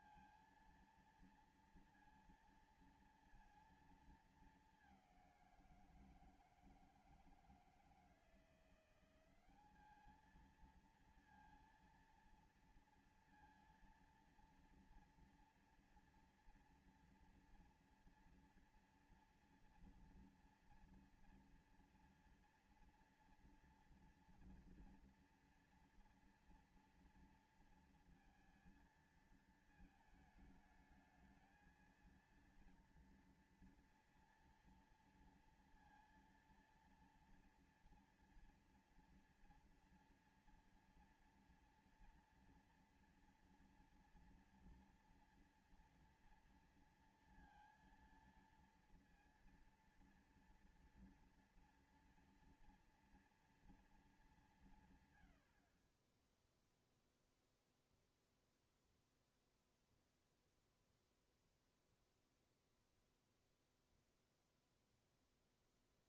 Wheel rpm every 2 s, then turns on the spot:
230, 230, 220, 170, 170, 210, 230, 230, 240, 230, 230, 230, 230, 240, 230, 220, 230, 230, 230, 230, 230, 240, 240, 230, 230, 230, 230, 210, 50, 0, 0, 0, 0.
none